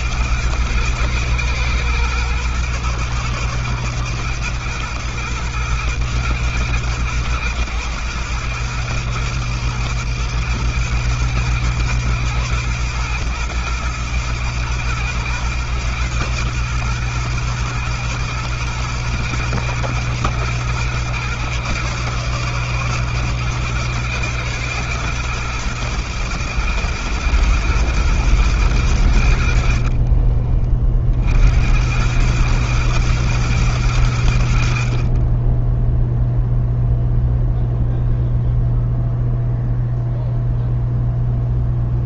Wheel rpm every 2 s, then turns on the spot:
110, 110, 110, 120, 110, 110, 110, 120, 120, 120, 120, 120, 120, 120, 50, 90, 110, 10, 0, 0, 0.
28-30